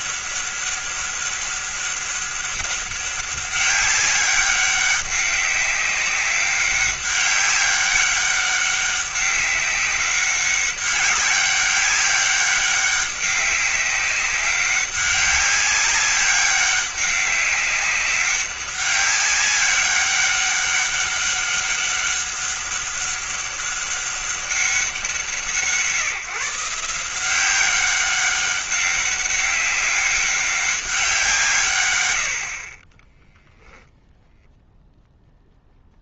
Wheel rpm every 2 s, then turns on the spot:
200, 200, 200, 200, 190, 200, 200, 200, 200, 200, 200, 200, 180, 170, 200, 190, 30, 0.
none